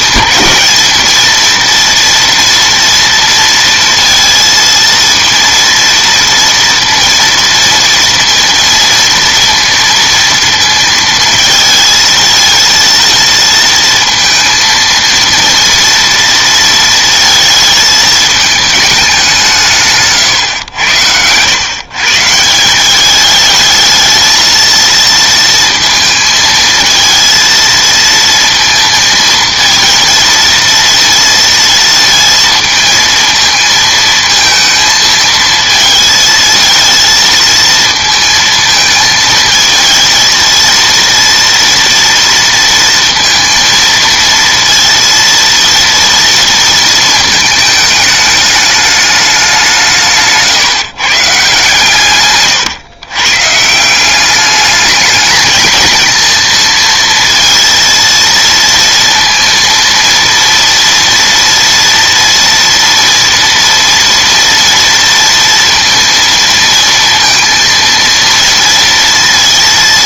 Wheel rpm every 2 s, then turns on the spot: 220, 230, 230, 230, 230, 230, 230, 230, 230, 220, 110, 170, 220, 220, 230, 230, 230, 220, 220, 220, 230, 230, 230, 230, 210, 160, 120, 210, 230, 230, 230, 230, 230, 230, 230.
none